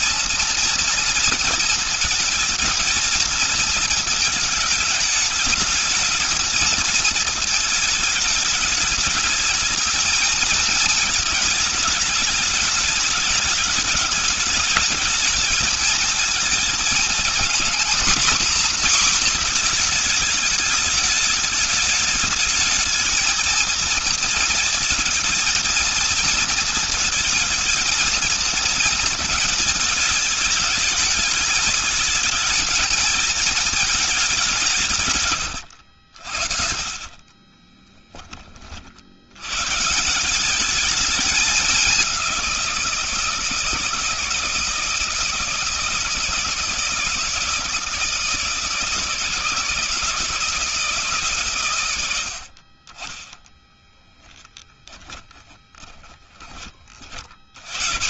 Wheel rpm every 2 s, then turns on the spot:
240, 220, 210, 220, 210, 220, 210, 220, 220, 250, 210, 220, 230, 220, 220, 210, 220, 160, 40, 50, 200, 180, 160, 160, 160, 160, 60, 20, 50.
36-38 54-56